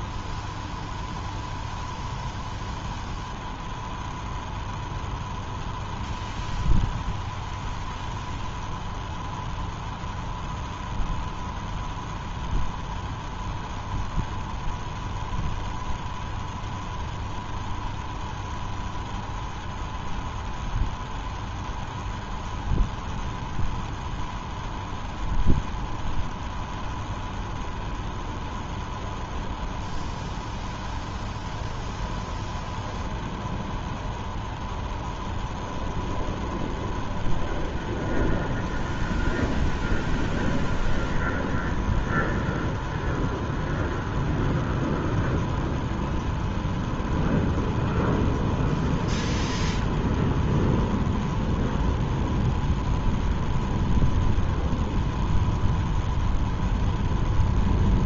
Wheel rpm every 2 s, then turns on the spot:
0, 0, 0, 0, 0, 0, 0, 0, 0, 0, 0, 0, 0, 0, 0, 0, 0, 0, 0, 0, 0, 0, 0, 0, 0, 0, 0, 0, 0.
none